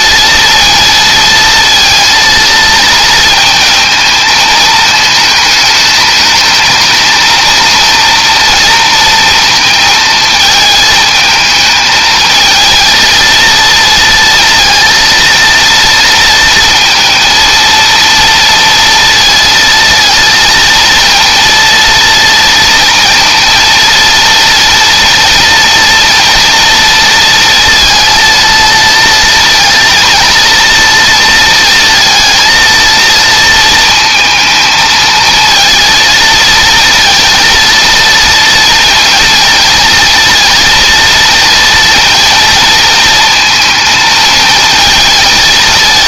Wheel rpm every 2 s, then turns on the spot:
230, 230, 220, 220, 230, 220, 230, 230, 230, 230, 230, 230, 230, 230, 230, 230, 230, 220, 230, 230, 230, 230, 220.
none